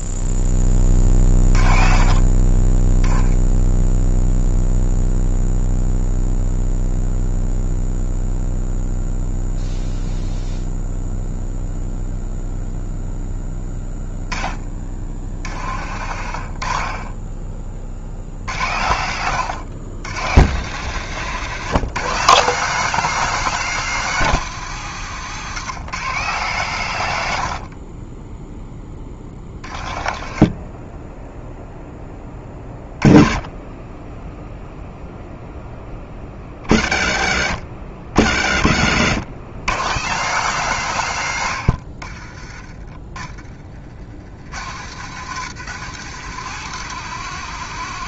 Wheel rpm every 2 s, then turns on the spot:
20, 20, 0, 0, 0, 0, 0, 20, 40, 80, 120, 180, 160, 150, 10, 20, 20, 0, 40, 70, 160, 30, 90, 140.
14-18 30-32 38-40